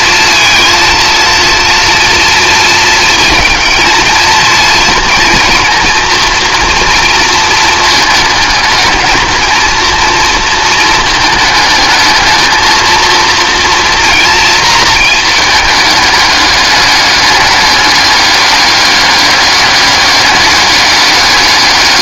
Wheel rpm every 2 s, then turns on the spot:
230, 230, 230, 240, 220, 220, 220, 220, 210, 200, 200.
none